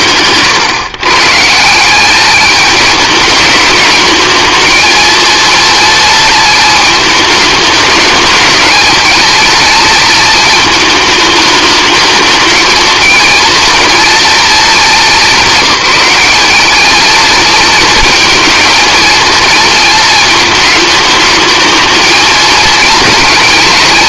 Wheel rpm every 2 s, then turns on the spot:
130, 210, 230, 220, 220, 220, 230, 210, 220, 220, 220, 230.
none